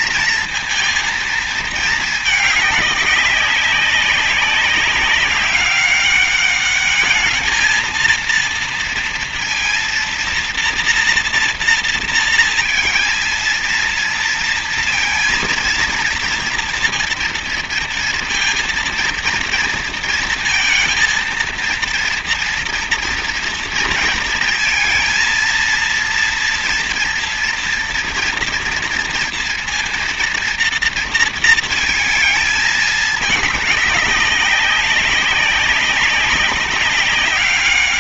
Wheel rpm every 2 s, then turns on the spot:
230, 190, 200, 210, 230, 240, 230, 230, 230, 230, 230, 230, 230, 240, 230, 230, 210, 190, 200.
none